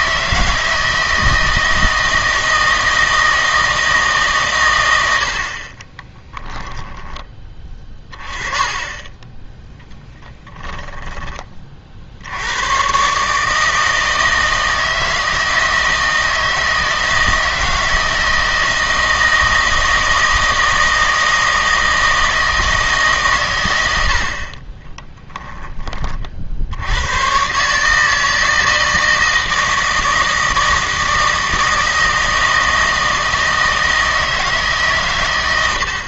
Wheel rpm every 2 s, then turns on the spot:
160, 160, 100, 10, 20, 10, 110, 160, 160, 160, 160, 160, 20, 80, 160, 160, 160, 140.
6-8 10-12 24-26